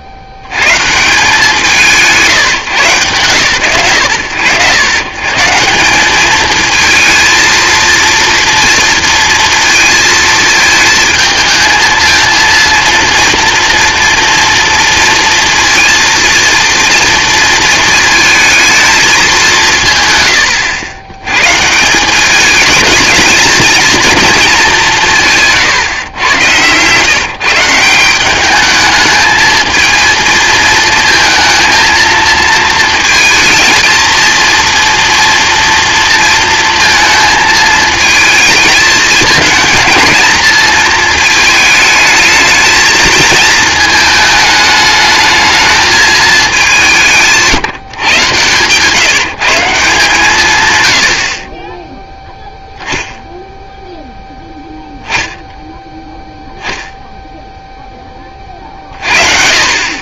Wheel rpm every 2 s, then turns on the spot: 90, 140, 110, 220, 230, 220, 230, 230, 230, 220, 90, 210, 200, 120, 210, 230, 220, 230, 230, 220, 220, 220, 210, 200, 130, 140, 0, 0, 0, 50.
none